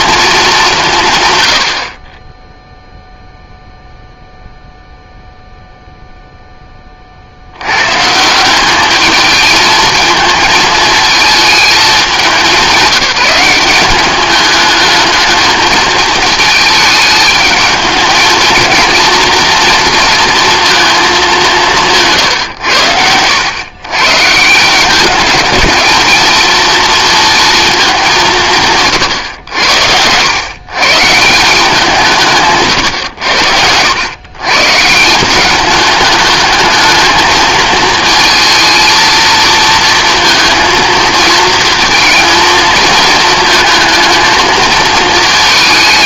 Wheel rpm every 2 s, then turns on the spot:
190, 0, 0, 10, 180, 220, 190, 210, 220, 230, 230, 110, 170, 230, 150, 130, 140, 120, 220, 230, 230, 230, 220.
none